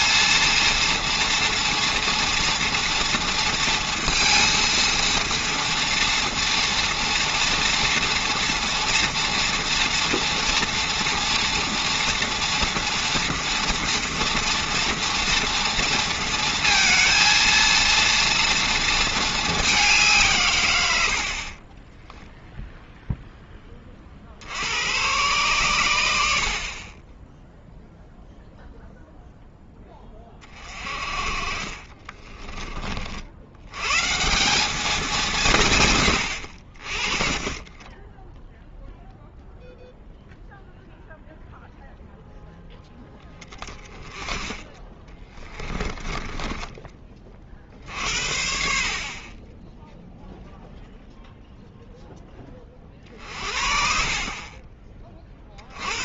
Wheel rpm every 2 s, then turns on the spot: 230, 230, 230, 230, 230, 230, 230, 230, 230, 230, 110, 0, 90, 40, 0, 30, 30, 200, 60, 0, 0, 0, 20, 20, 50, 0, 30, 30.
44-46 54-56